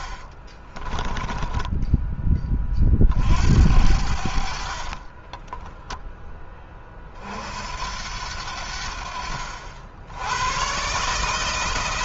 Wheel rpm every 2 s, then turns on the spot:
20, 30, 60, 30, 80, 130.
4-6